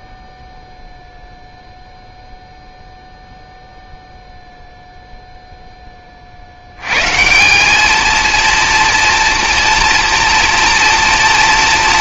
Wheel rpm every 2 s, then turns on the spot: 0, 0, 0, 100, 230, 230.
none